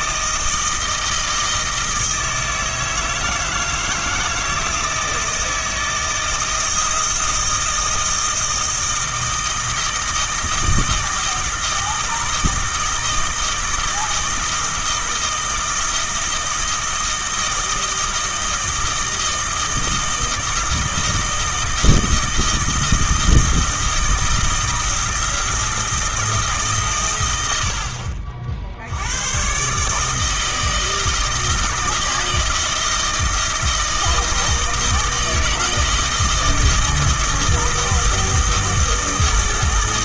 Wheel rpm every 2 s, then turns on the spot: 160, 160, 160, 160, 160, 160, 160, 160, 160, 160, 160, 160, 160, 140, 60, 160, 160, 160, 160, 160.
none